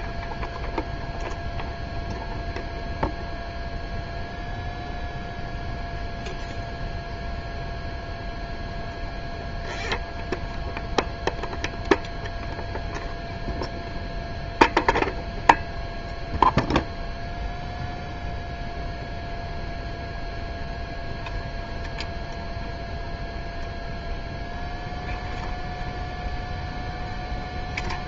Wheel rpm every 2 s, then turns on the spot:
0, 0, 0, 0, 0, 0, 0, 0, 0, 0, 0, 0, 0, 0.
none